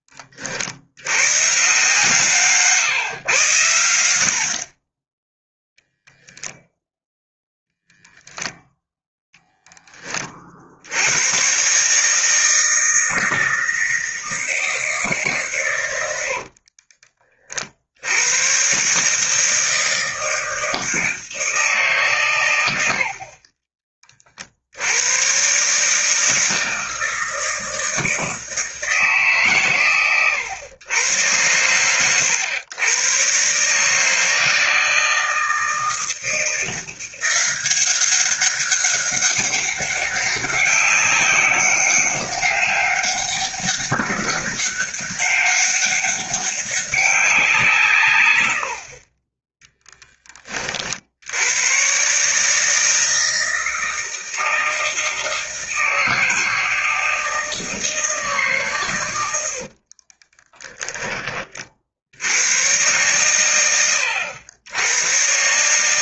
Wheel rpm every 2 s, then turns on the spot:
80, 140, 30, 0, 0, 70, 160, 160, 40, 140, 160, 90, 80, 160, 150, 100, 120, 160, 170, 200, 190, 200, 200, 200, 50, 50, 160, 160, 160, 130, 20, 110, 100.
16-18